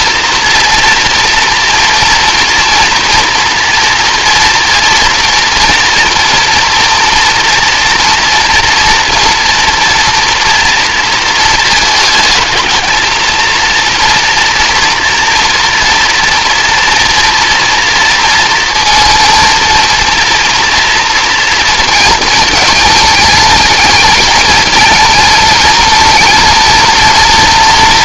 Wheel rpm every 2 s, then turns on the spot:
230, 230, 240, 230, 230, 230, 220, 230, 230, 230, 230, 210, 220, 230.
none